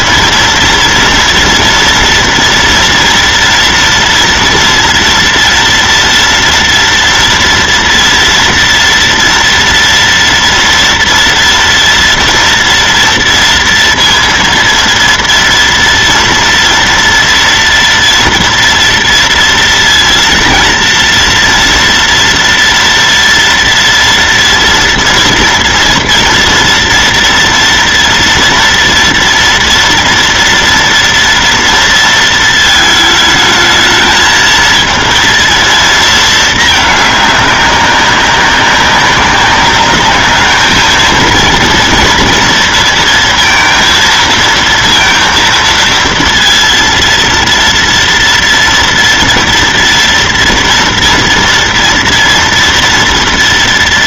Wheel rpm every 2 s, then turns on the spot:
230, 230, 230, 230, 230, 230, 230, 230, 230, 230, 230, 230, 230, 230, 230, 230, 220, 230, 220, 200, 210, 230, 230, 230, 230, 230, 230.
none